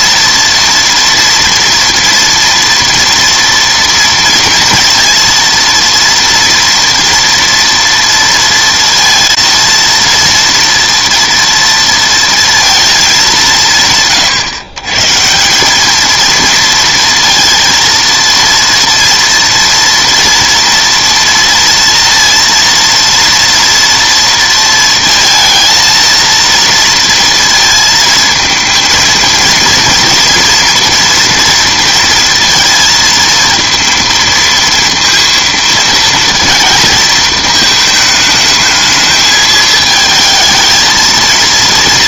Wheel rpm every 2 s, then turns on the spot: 230, 230, 230, 230, 230, 230, 230, 130, 230, 230, 230, 230, 230, 230, 220, 230, 230, 230, 230, 220, 220.
none